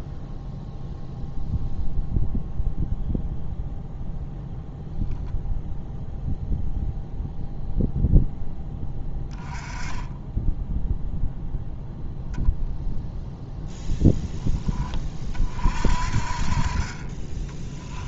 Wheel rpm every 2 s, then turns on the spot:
0, 0, 0, 0, 10, 0, 0, 10, 40.
none